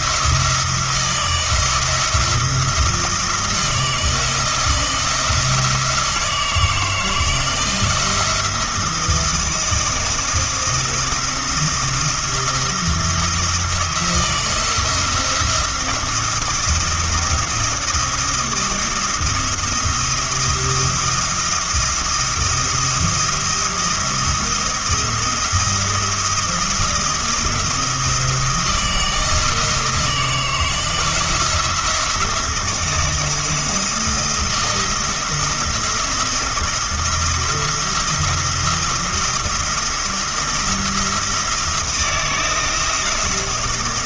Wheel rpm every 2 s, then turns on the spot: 170, 170, 170, 160, 170, 170, 170, 170, 170, 170, 170, 170, 170, 170, 160, 170, 170, 170, 170, 170, 170, 170.
none